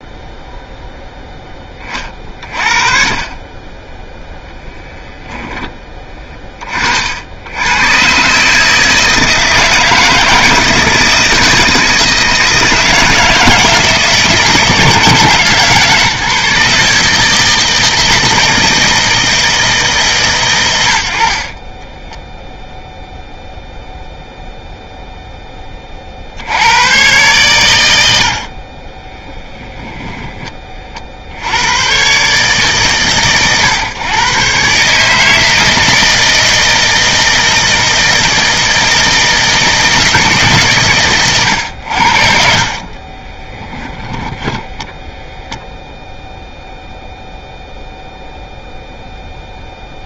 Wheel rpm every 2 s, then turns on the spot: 0, 40, 0, 60, 150, 160, 160, 160, 150, 160, 60, 0, 0, 100, 30, 40, 120, 140, 160, 160, 140, 30, 0, 0, 0.
20-22 28-30 42-44